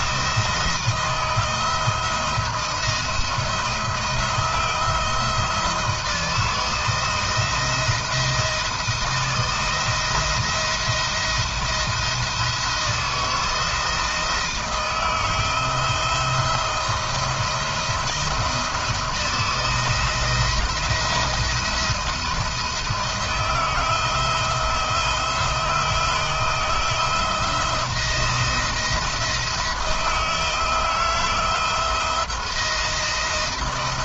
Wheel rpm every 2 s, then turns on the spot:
170, 170, 160, 170, 170, 170, 170, 160, 170, 170, 170, 170, 160, 160, 170, 160, 170.
none